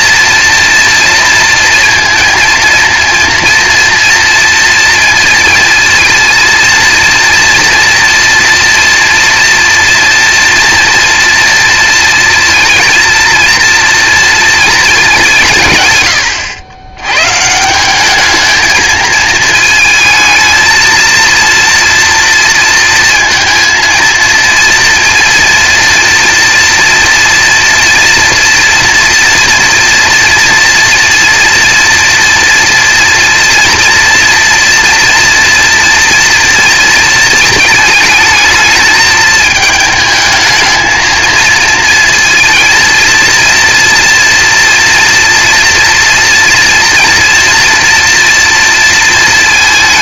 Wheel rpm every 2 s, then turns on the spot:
230, 230, 230, 230, 230, 240, 230, 220, 100, 220, 220, 230, 230, 230, 230, 230, 230, 230, 230, 220, 220, 230, 230, 230, 230.
none